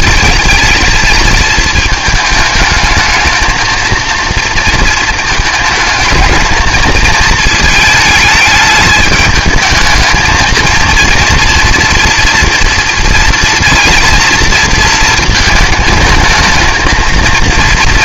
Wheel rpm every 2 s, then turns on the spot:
220, 220, 220, 220, 210, 230, 240, 230, 220.
none